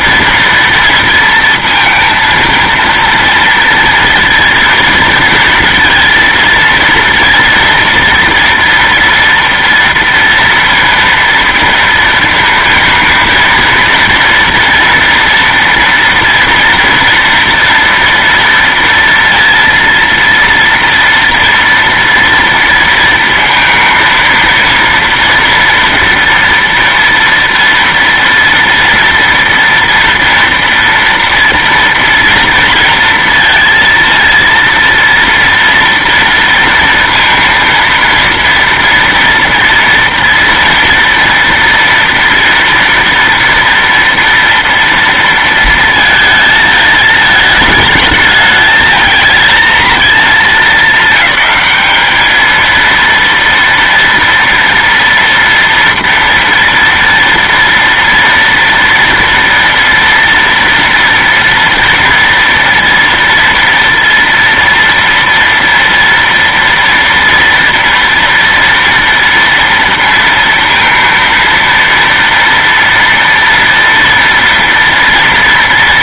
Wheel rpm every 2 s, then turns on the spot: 230, 230, 230, 230, 230, 230, 230, 230, 240, 230, 230, 230, 230, 230, 230, 240, 230, 230, 230, 230, 230, 230, 230, 220, 220, 220, 220, 230, 230, 230, 230, 240, 230, 230, 230, 230, 230, 230.
none